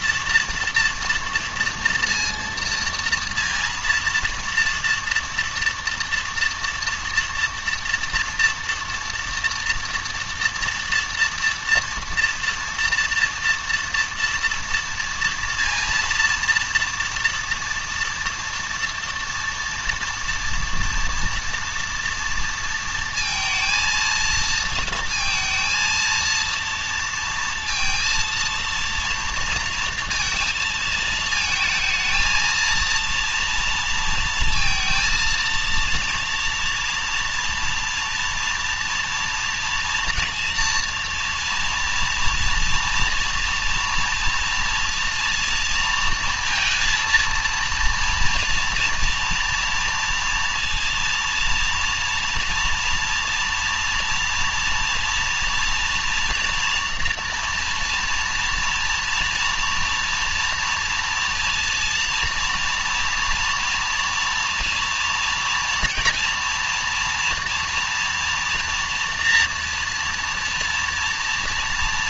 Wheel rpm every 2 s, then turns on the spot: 230, 230, 230, 230, 230, 230, 230, 230, 230, 230, 230, 230, 230, 230, 230, 220, 230, 230, 240, 230, 230, 230, 230, 230, 230, 230, 240, 230, 230, 230, 230, 240, 230, 230, 230, 230.
none